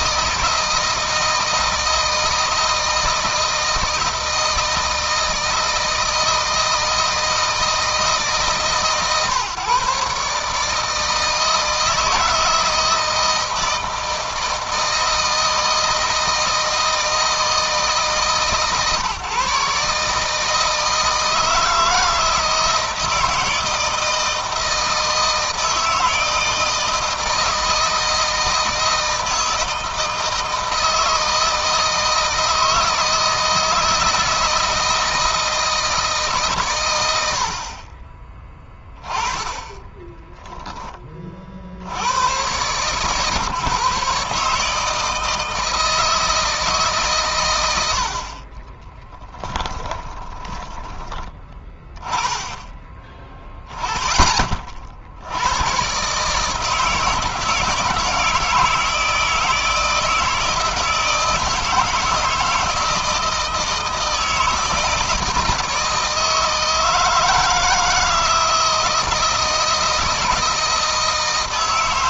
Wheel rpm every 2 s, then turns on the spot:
160, 160, 160, 160, 140, 150, 160, 160, 160, 140, 160, 160, 160, 160, 160, 160, 160, 160, 110, 10, 10, 120, 150, 150, 20, 20, 10, 50, 160, 160, 160, 160, 160, 160, 160, 160.
48-50